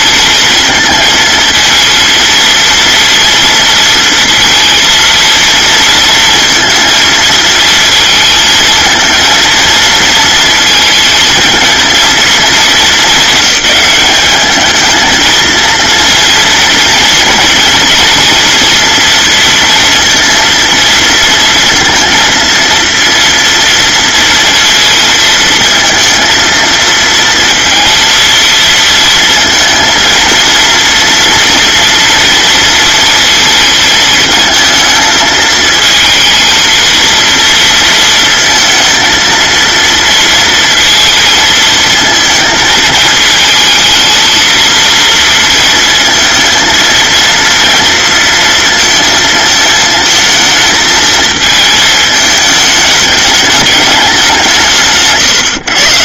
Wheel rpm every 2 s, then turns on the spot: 220, 230, 230, 230, 230, 220, 220, 220, 230, 230, 230, 230, 230, 230, 230, 230, 230, 220, 230, 230, 230, 220, 230, 230, 230, 220, 210, 150.
none